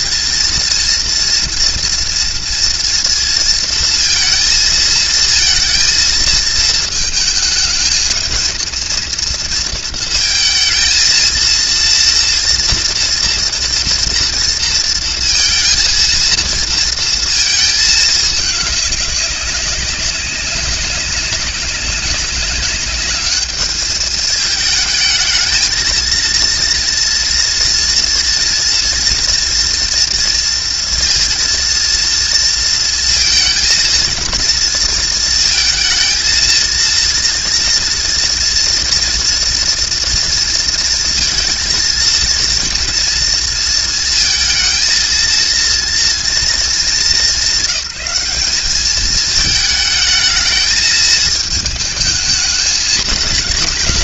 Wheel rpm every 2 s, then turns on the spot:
230, 230, 230, 220, 230, 230, 240, 230, 230, 200, 190, 200, 220, 230, 230, 230, 230, 220, 230, 230, 230, 230, 230, 190, 210, 220, 220.
none